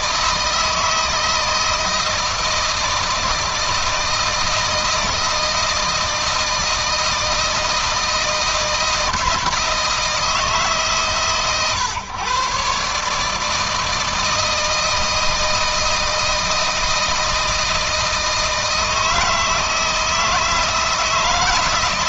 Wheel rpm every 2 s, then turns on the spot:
160, 160, 160, 160, 160, 140, 130, 160, 160, 160, 160.
none